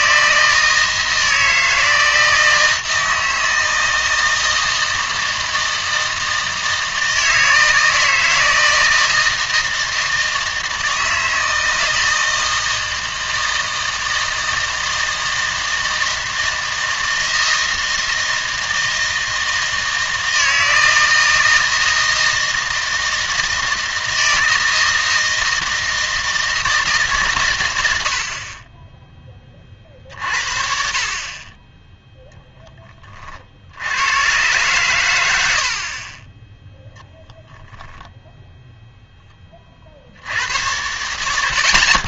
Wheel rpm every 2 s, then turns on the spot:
160, 160, 160, 160, 160, 160, 160, 160, 160, 160, 160, 160, 160, 160, 40, 50, 20, 130, 10, 0, 90.
none